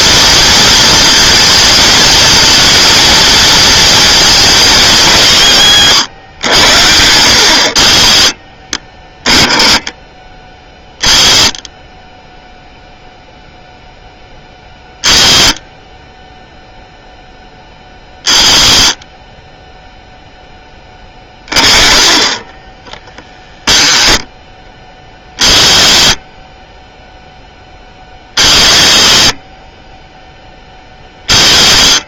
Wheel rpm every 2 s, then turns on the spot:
230, 230, 220, 100, 30, 20, 0, 10, 0, 20, 10, 10, 20, 10, 40, 20.
none